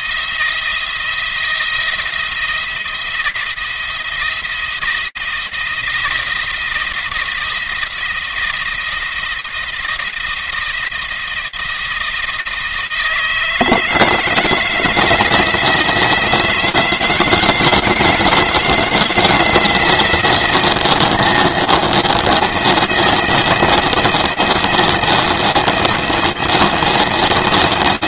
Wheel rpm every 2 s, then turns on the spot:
170, 170, 170, 170, 170, 170, 160, 160, 160, 160, 170, 170, 170, 170.
none